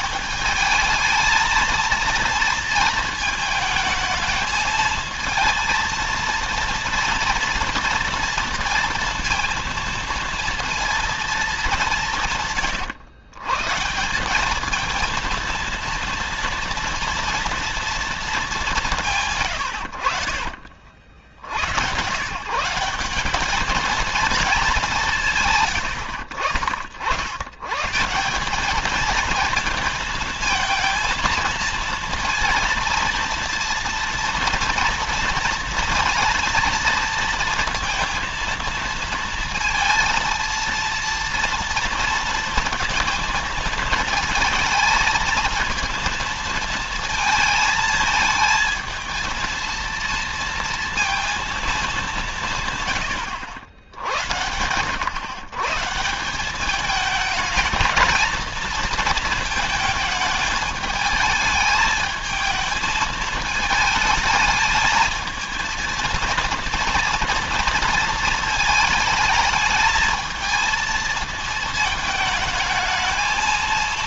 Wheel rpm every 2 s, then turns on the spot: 210, 230, 220, 230, 230, 230, 120, 220, 230, 160, 50, 180, 200, 80, 210, 220, 230, 230, 230, 230, 230, 230, 220, 230, 220, 230, 140, 100, 210, 230, 220, 220, 220, 230, 220, 220, 220.
none